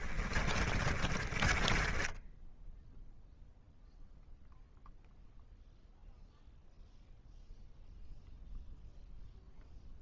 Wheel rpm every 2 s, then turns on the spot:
20, 10, 0, 0, 0.
0-2